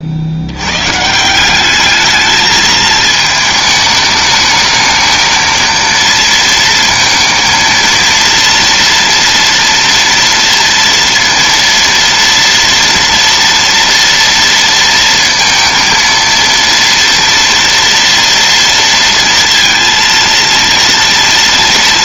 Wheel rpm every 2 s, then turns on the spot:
110, 220, 220, 230, 230, 230, 230, 230, 230, 230, 230.
none